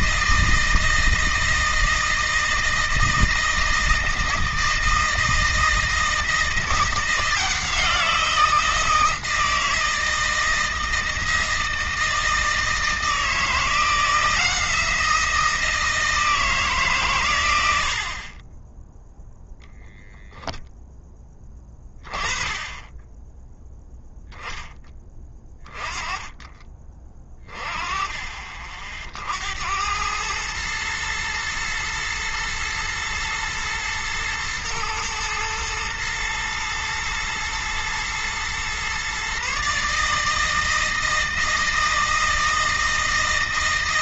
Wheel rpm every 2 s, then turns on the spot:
160, 160, 160, 170, 170, 160, 160, 170, 130, 0, 10, 10, 20, 20, 60, 110, 110, 110, 120, 130, 160, 160.
none